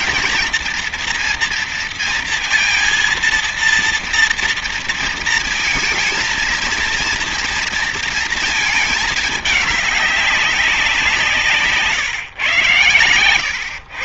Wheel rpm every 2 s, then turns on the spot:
230, 230, 230, 230, 220, 180, 130.
none